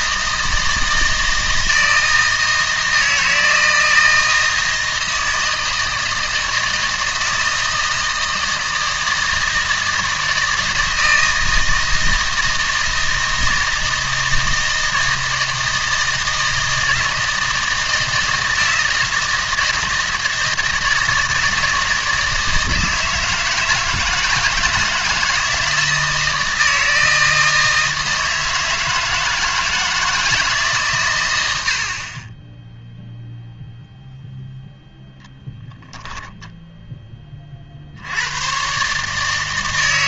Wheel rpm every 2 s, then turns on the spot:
160, 160, 160, 160, 160, 160, 160, 160, 160, 160, 160, 160, 160, 160, 160, 140, 0, 0, 0, 130.
none